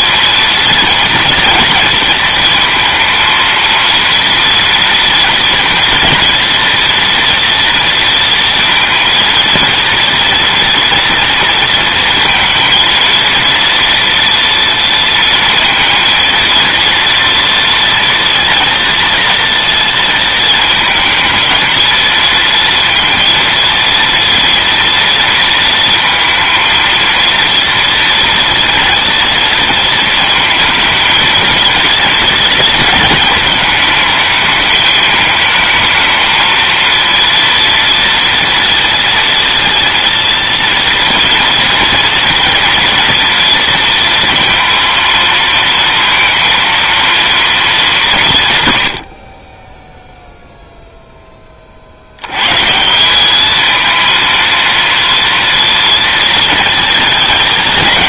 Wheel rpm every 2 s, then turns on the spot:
230, 230, 230, 230, 230, 230, 230, 230, 230, 230, 220, 230, 230, 230, 230, 220, 220, 210, 230, 230, 230, 230, 230, 230, 110, 0, 160, 230, 230.
none